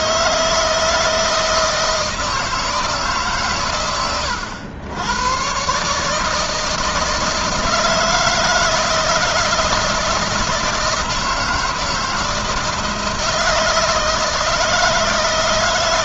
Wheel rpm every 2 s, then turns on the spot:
160, 150, 90, 160, 160, 160, 160, 160.
none